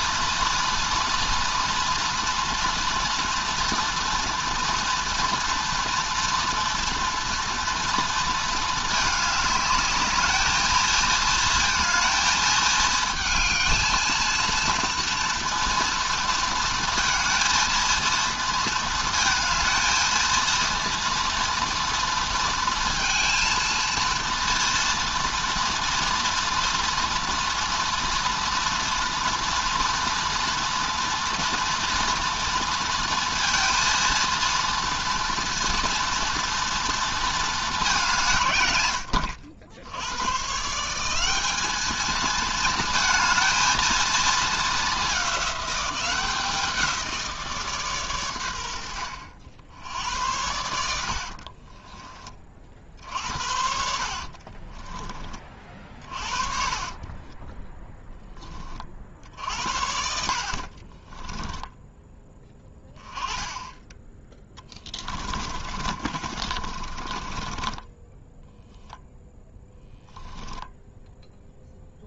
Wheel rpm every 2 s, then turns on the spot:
230, 230, 230, 230, 220, 220, 220, 230, 230, 230, 230, 230, 230, 230, 230, 230, 230, 230, 230, 150, 120, 220, 220, 180, 110, 80, 30, 30, 40, 20, 60, 10, 20, 40, 10, 10.
50-52 54-58 64-70